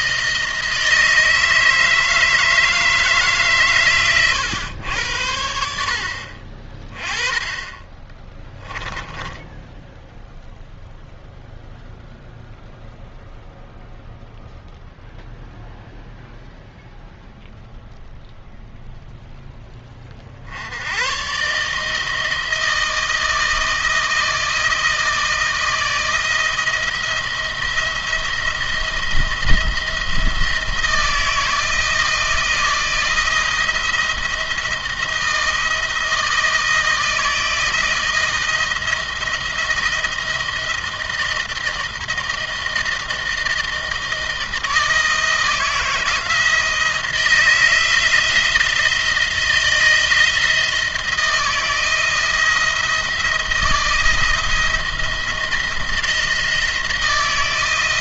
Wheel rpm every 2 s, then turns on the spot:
160, 150, 90, 30, 10, 0, 0, 0, 0, 0, 100, 160, 160, 170, 170, 160, 170, 170, 160, 170, 160, 160, 160, 160, 170, 170, 160, 170, 170.
8-10